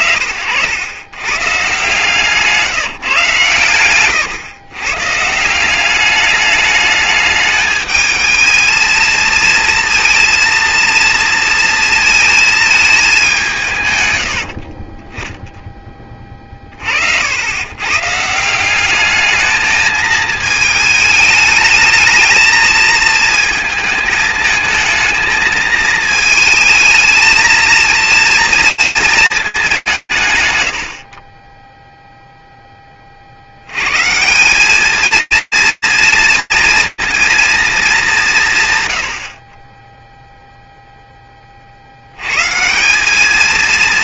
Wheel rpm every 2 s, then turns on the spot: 80, 160, 120, 210, 220, 230, 220, 50, 60, 190, 220, 220, 220, 220, 230, 150, 0, 190, 230, 190, 0, 120.
14-16